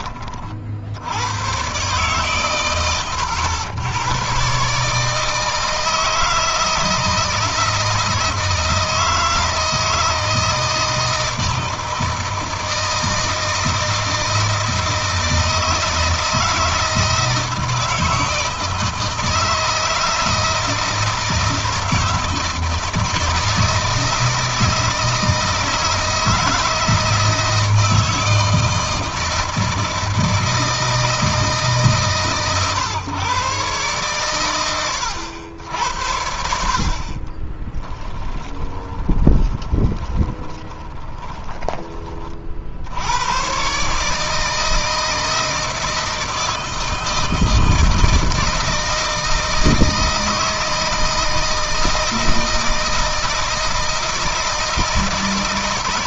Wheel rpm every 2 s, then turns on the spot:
70, 110, 140, 160, 160, 160, 160, 160, 160, 160, 160, 160, 160, 160, 160, 160, 120, 100, 50, 20, 20, 70, 160, 160, 160, 160, 160, 160.
36-42